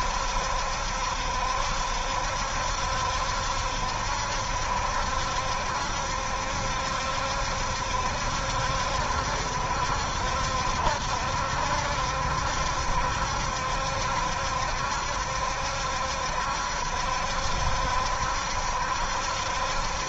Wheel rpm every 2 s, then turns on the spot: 70, 70, 70, 70, 70, 70, 70, 70, 70, 70.
none